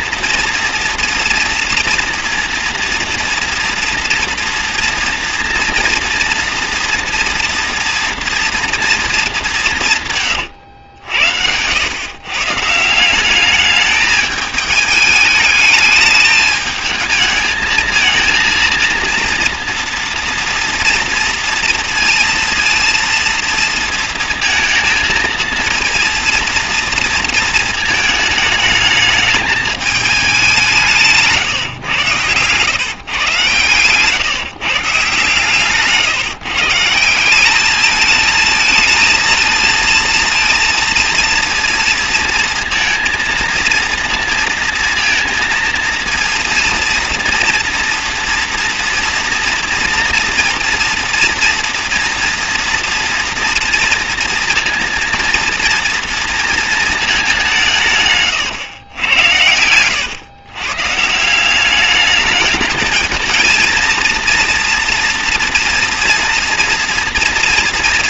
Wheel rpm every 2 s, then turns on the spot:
240, 230, 230, 230, 230, 110, 150, 210, 220, 230, 230, 230, 230, 230, 220, 180, 120, 140, 150, 220, 230, 230, 230, 230, 230, 230, 230, 230, 230, 120, 130, 210, 230, 230.
10-12